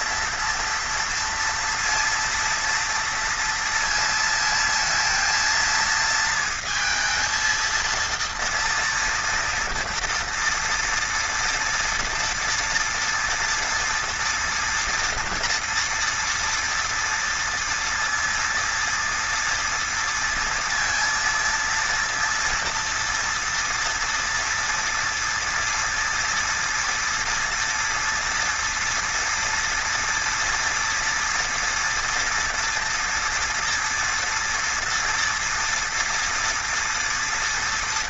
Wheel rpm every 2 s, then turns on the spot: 230, 230, 220, 230, 230, 230, 230, 230, 230, 230, 230, 240, 230, 240, 230, 230, 230, 230, 240.
none